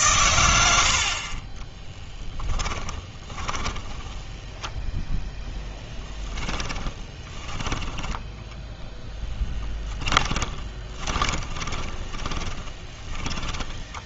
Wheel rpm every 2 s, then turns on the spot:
70, 10, 0, 10, 10, 20, 20.
2-4 8-14